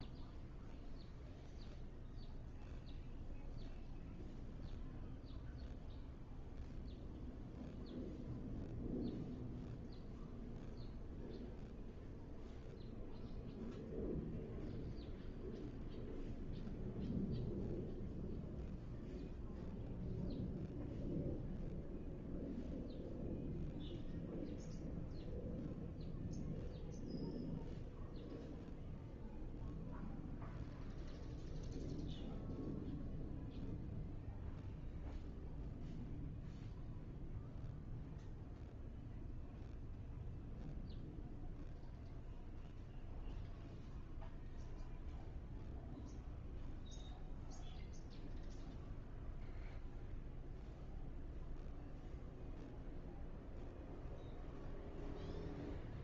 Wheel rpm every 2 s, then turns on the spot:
0, 0, 0, 0, 0, 0, 0, 0, 0, 0, 0, 0, 0, 0, 0, 0, 0, 0, 0, 0, 0, 0, 0, 0, 0, 0, 0, 0.
none